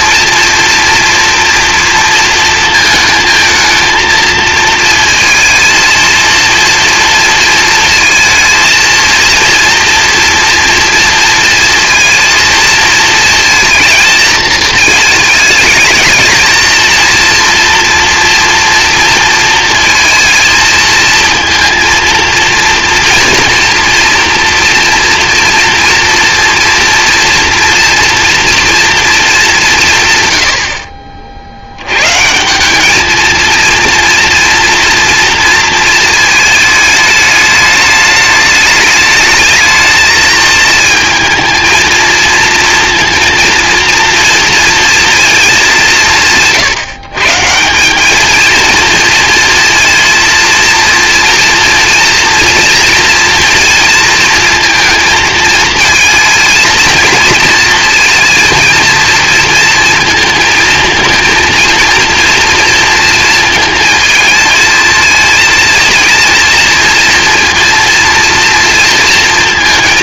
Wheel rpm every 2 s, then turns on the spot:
230, 230, 230, 230, 230, 230, 230, 220, 220, 230, 230, 230, 240, 230, 230, 100, 170, 230, 220, 210, 220, 230, 230, 150, 230, 230, 230, 230, 230, 230, 230, 230, 220, 230, 230.
none